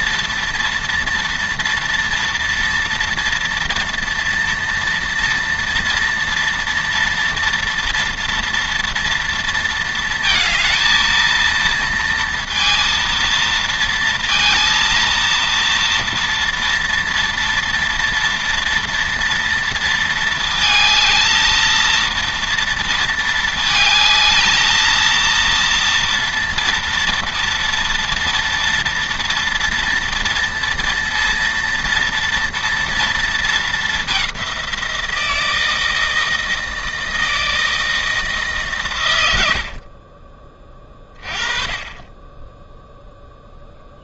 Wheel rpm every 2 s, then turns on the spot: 230, 230, 230, 230, 230, 230, 230, 230, 230, 230, 220, 230, 230, 230, 230, 230, 230, 170, 160, 120, 30, 0.
none